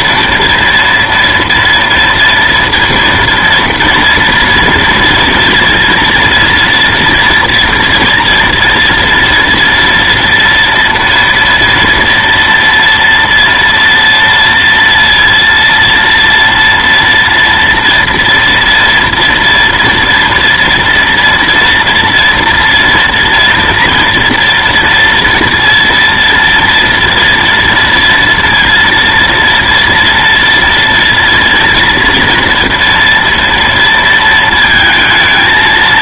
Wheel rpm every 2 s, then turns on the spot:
230, 230, 230, 230, 240, 230, 230, 230, 230, 230, 230, 230, 230, 230, 230, 230, 230, 230.
none